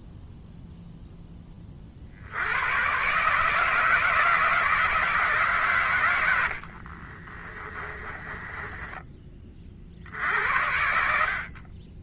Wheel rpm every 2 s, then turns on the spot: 0, 100, 150, 60, 10, 80.
6-10